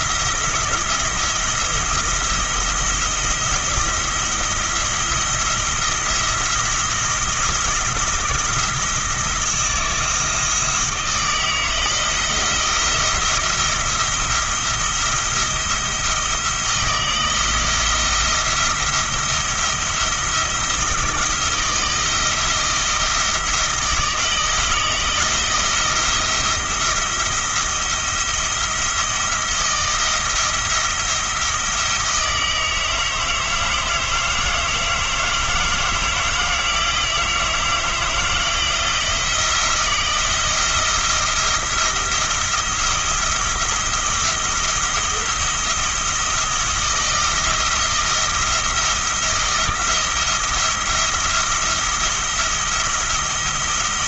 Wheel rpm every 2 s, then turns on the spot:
170, 170, 160, 170, 170, 160, 170, 170, 160, 170, 170, 170, 160, 170, 170, 170, 160, 160, 160, 160, 170, 170, 170, 170, 170, 170, 170.
none